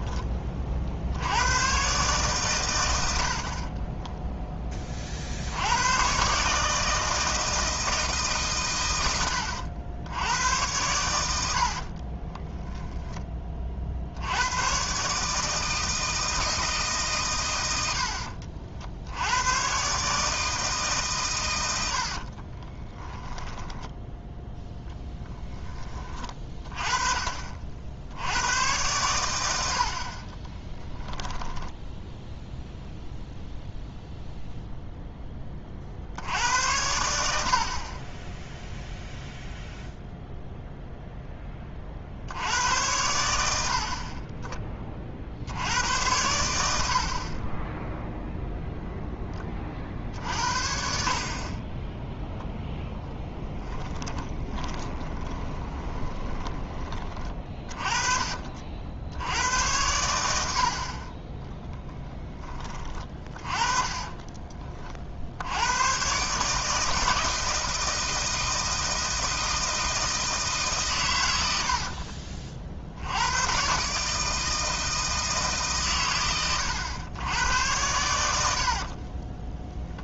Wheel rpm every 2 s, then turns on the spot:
40, 110, 20, 150, 120, 90, 10, 110, 160, 50, 150, 20, 10, 30, 100, 10, 0, 0, 80, 0, 0, 90, 30, 80, 0, 60, 0, 20, 20, 50, 70, 20, 40, 160, 160, 140, 60, 160, 100, 60.
12-14 22-24 30-32 54-56 78-80